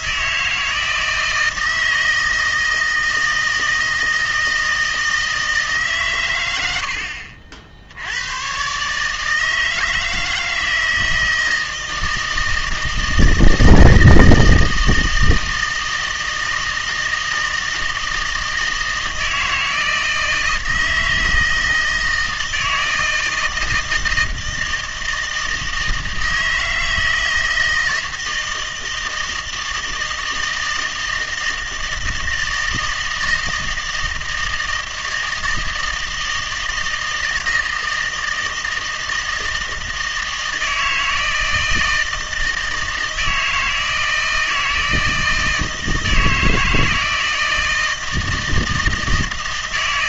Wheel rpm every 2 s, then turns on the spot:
160, 160, 160, 100, 120, 160, 160, 160, 160, 160, 160, 160, 160, 160, 160, 160, 160, 160, 160, 160, 160, 160, 160, 160, 160.
none